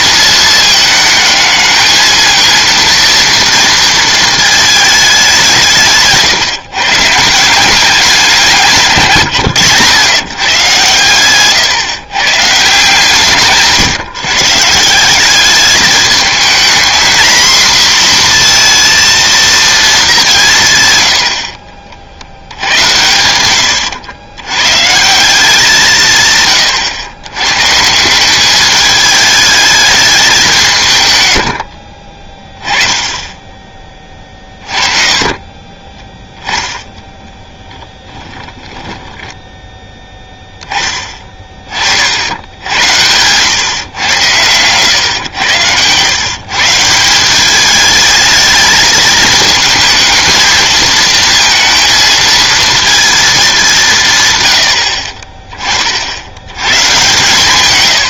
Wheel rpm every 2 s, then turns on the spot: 220, 230, 220, 150, 180, 120, 140, 150, 220, 230, 150, 80, 120, 120, 200, 170, 20, 30, 0, 10, 10, 90, 110, 150, 220, 220, 230, 100, 110.
38-40